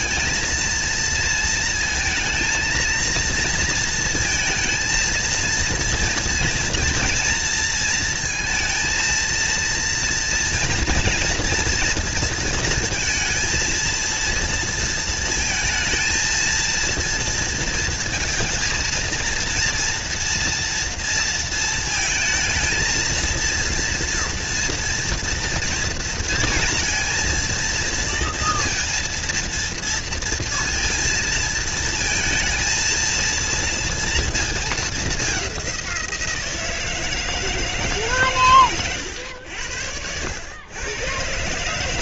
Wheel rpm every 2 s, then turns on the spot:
220, 230, 230, 230, 230, 230, 230, 230, 230, 230, 230, 220, 230, 230, 230, 230, 230, 210, 160, 120, 100.
none